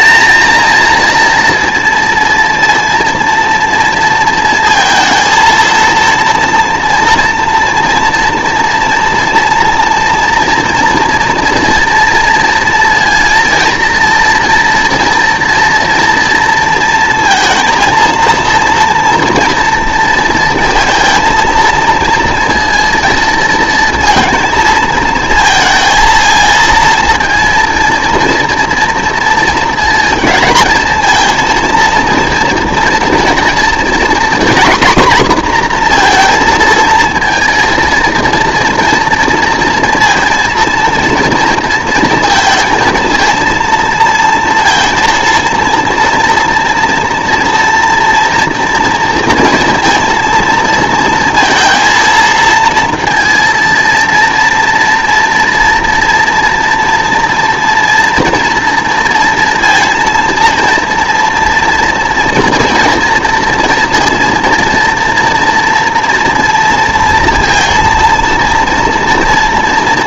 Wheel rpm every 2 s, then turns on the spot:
230, 230, 230, 230, 240, 230, 230, 240, 230, 230, 230, 230, 230, 230, 230, 220, 230, 250, 230, 230, 230, 230, 230, 230, 230, 230, 230, 230, 240, 230, 230, 240, 230, 230, 230.
none